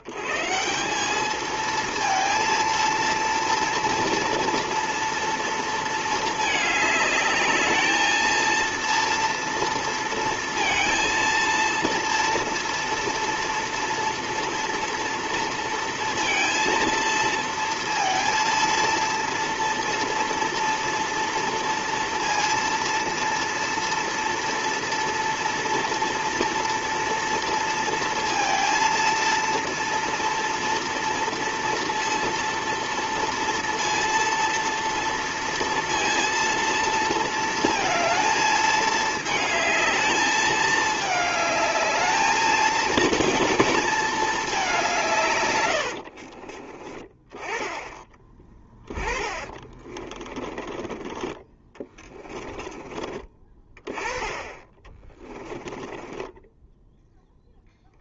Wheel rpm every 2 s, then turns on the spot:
110, 230, 230, 220, 220, 230, 230, 230, 230, 230, 230, 230, 230, 240, 230, 230, 230, 230, 230, 220, 210, 220, 220, 50, 10, 20, 20, 20, 10.
46-48 50-54 56-58